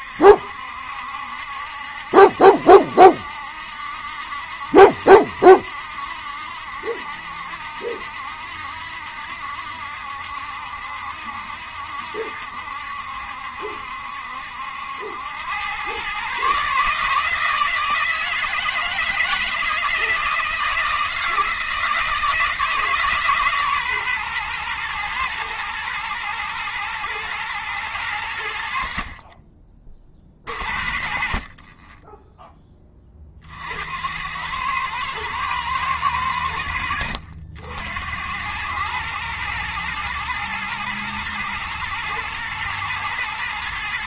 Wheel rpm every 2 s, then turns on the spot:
70, 70, 70, 60, 70, 70, 70, 80, 150, 160, 160, 160, 120, 120, 70, 50, 10, 100, 90, 100, 120, 110.
none